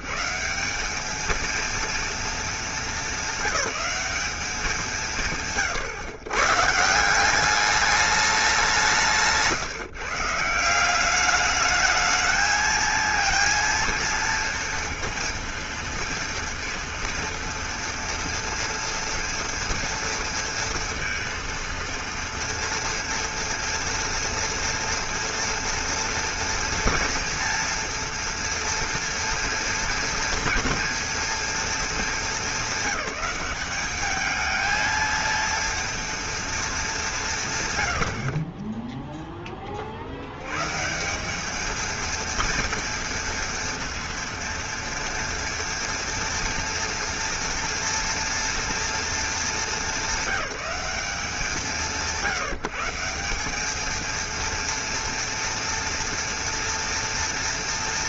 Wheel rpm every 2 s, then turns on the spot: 120, 230, 210, 130, 210, 150, 220, 230, 230, 230, 230, 230, 230, 230, 230, 230, 210, 210, 230, 60, 70, 230, 230, 230, 230, 200, 170, 230, 230.
none